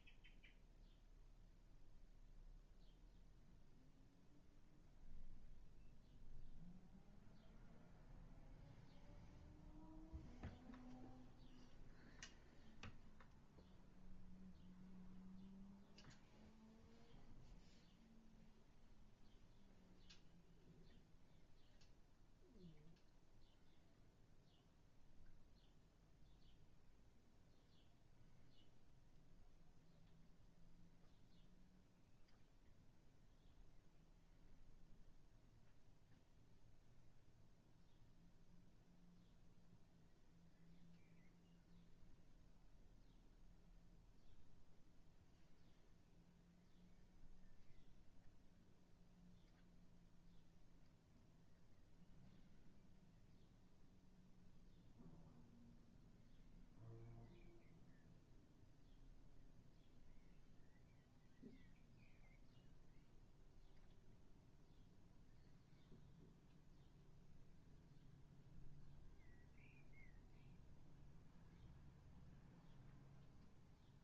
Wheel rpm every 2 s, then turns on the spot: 0, 0, 0, 0, 0, 0, 0, 0, 0, 0, 0, 0, 0, 0, 0, 0, 0, 0, 0, 0, 0, 0, 0, 0, 0, 0, 0, 0, 0, 0, 0, 0, 0, 0, 0, 0, 0.
none